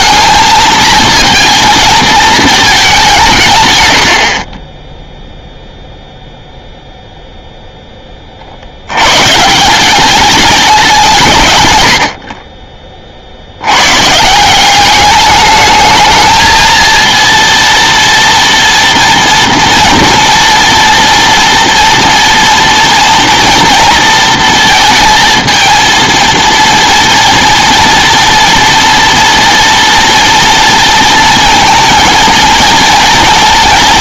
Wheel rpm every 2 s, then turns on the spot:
220, 220, 30, 0, 50, 190, 40, 180, 220, 230, 230, 230, 230, 230, 230, 230, 230.
none